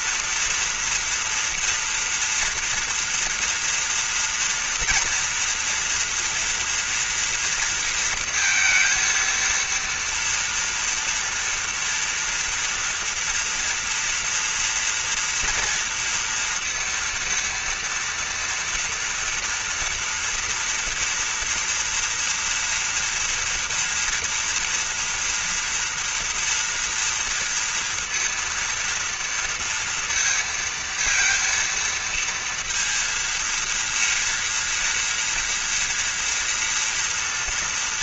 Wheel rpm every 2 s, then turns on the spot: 240, 230, 240, 240, 230, 240, 230, 240, 230, 230, 230, 230, 230, 240, 230, 230, 230, 230, 230.
none